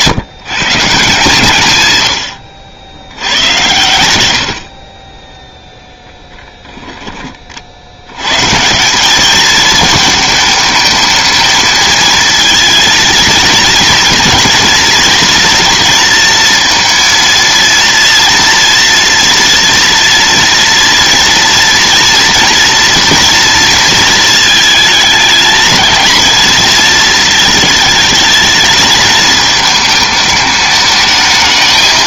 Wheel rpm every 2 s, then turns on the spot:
170, 80, 30, 20, 200, 220, 230, 240, 230, 240, 230, 230, 220, 220, 220, 210.
4-6